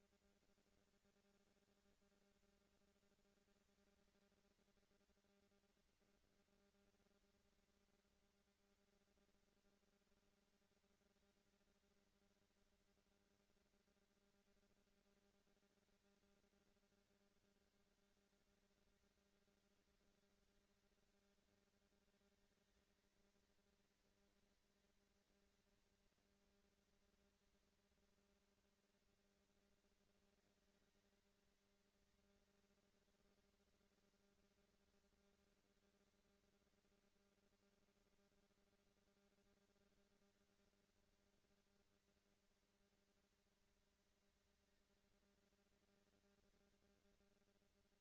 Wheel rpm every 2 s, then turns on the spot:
220, 230, 230, 230, 240, 230, 230, 230, 220, 200, 200, 220, 230, 230, 230, 230, 230, 230, 230, 230, 230, 230, 230, 240.
none